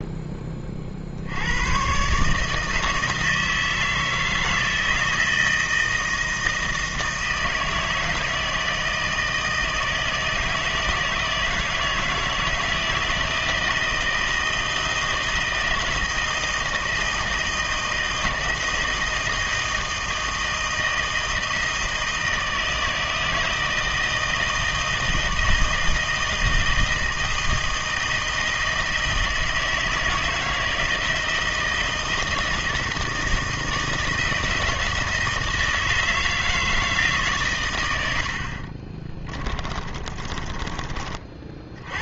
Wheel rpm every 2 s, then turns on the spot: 70, 160, 160, 160, 160, 160, 160, 160, 160, 160, 160, 160, 160, 160, 160, 160, 160, 160, 150, 30, 30.
38-40